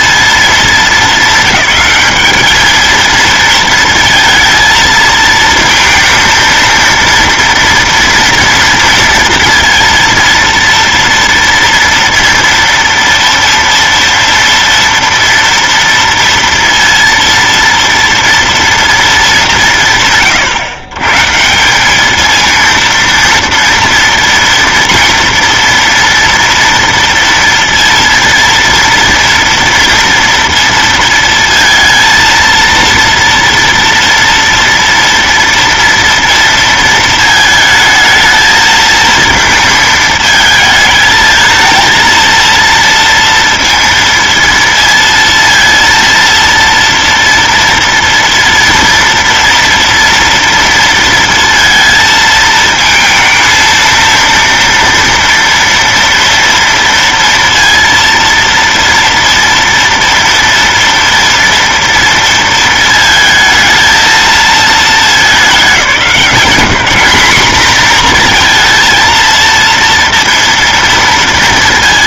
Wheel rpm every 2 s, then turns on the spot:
220, 220, 230, 230, 230, 230, 230, 230, 230, 230, 120, 230, 230, 240, 230, 230, 230, 230, 230, 220, 220, 230, 230, 230, 230, 230, 230, 230, 230, 230, 230, 230, 220, 200, 230, 230.
none